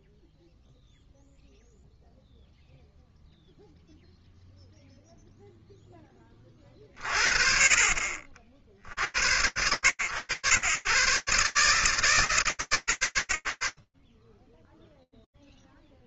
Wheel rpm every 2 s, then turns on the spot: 0, 0, 20, 50, 100, 150, 70, 0.
none